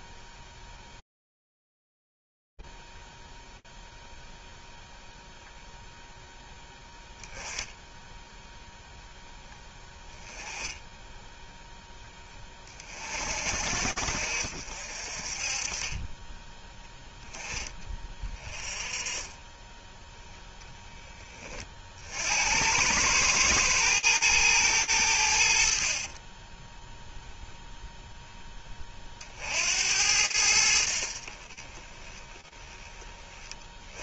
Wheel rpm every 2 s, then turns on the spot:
0, 0, 0, 0, 0, 10, 20, 60, 10, 20, 10, 100, 90, 0, 50, 40, 30.
10-12 16-18